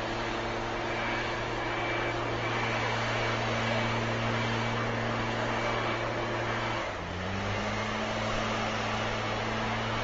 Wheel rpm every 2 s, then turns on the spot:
0, 0, 0, 0, 0.
none